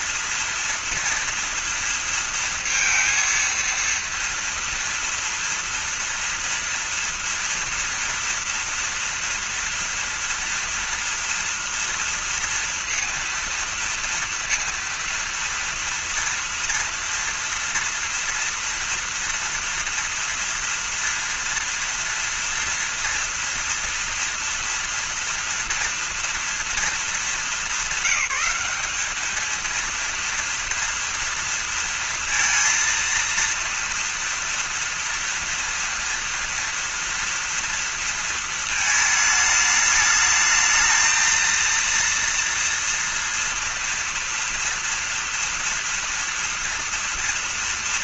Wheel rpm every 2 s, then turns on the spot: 230, 230, 230, 240, 230, 230, 230, 230, 230, 230, 230, 230, 230, 220, 200, 240, 230, 230, 230, 220, 220, 230, 230, 230.
none